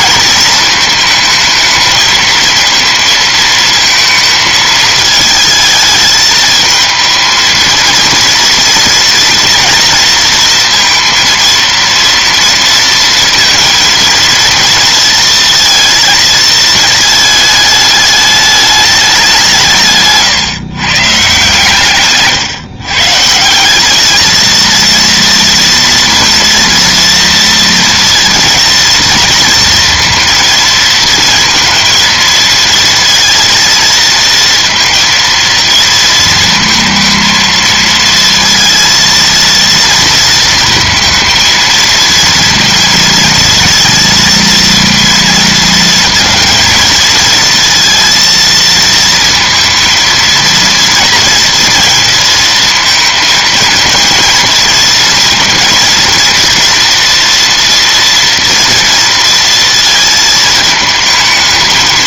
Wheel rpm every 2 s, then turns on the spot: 220, 230, 220, 220, 230, 230, 230, 230, 220, 200, 140, 140, 230, 230, 230, 230, 230, 230, 230, 230, 230, 230, 230, 220, 220, 230, 230, 230, 230, 230, 220.
none